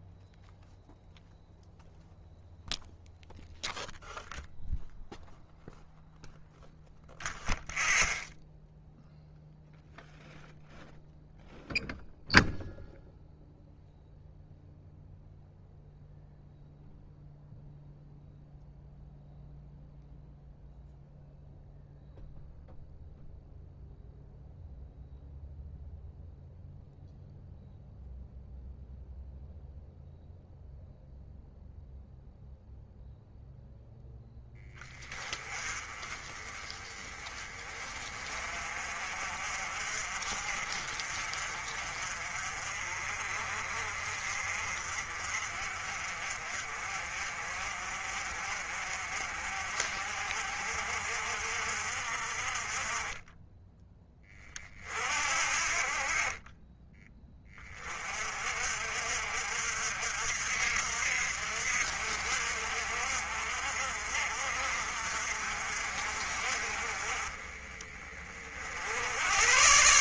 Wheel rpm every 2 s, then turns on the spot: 0, 0, 0, 0, 0, 0, 0, 0, 0, 0, 0, 0, 0, 0, 0, 0, 0, 10, 20, 40, 40, 40, 50, 40, 50, 50, 30, 40, 20, 50, 60, 60, 50, 40, 70.
none